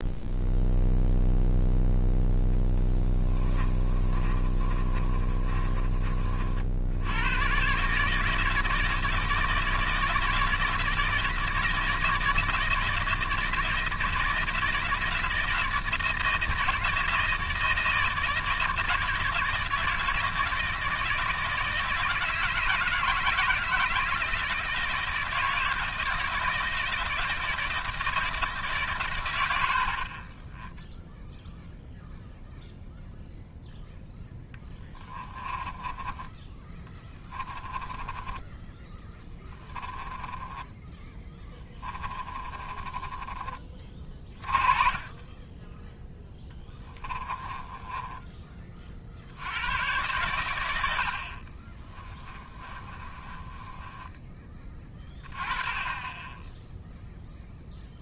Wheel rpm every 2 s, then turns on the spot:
0, 10, 30, 60, 160, 160, 160, 160, 160, 160, 160, 160, 160, 160, 150, 0, 0, 10, 10, 10, 20, 20, 30, 20, 30, 90, 30, 20, 0.
2-6 34-44 46-48 52-54